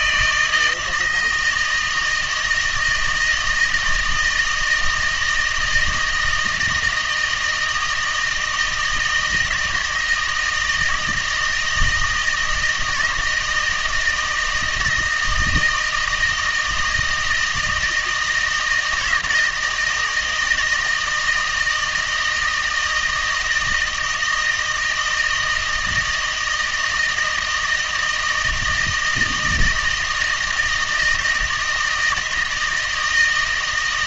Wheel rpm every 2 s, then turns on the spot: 160, 160, 160, 160, 160, 160, 160, 160, 160, 160, 160, 160, 160, 160, 160, 160, 160.
none